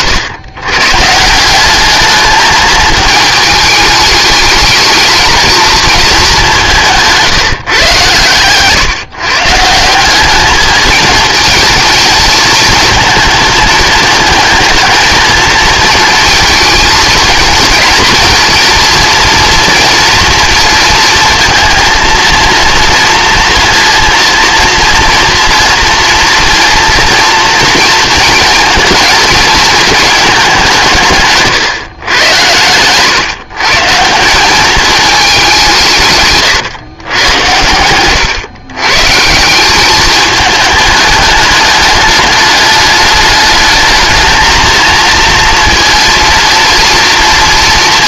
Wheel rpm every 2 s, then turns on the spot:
120, 220, 210, 190, 140, 210, 220, 220, 220, 230, 230, 230, 230, 230, 230, 180, 120, 210, 120, 140, 210, 210, 230, 230.
none